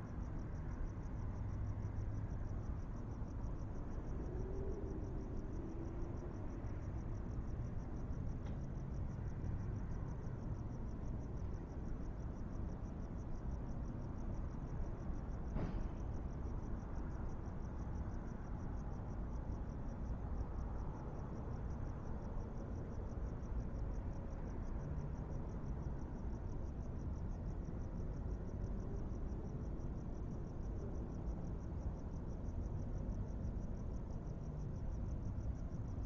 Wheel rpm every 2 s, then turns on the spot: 0, 0, 0, 0, 0, 0, 0, 0, 0, 0, 0, 0, 0, 0, 0, 0, 0, 0.
none